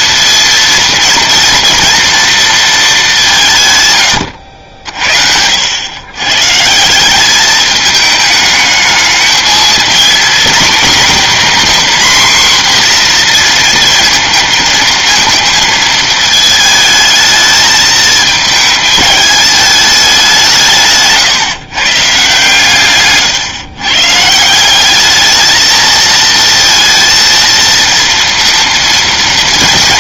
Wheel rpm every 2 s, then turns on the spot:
230, 220, 90, 150, 220, 240, 250, 220, 220, 220, 170, 140, 180, 230, 230.
none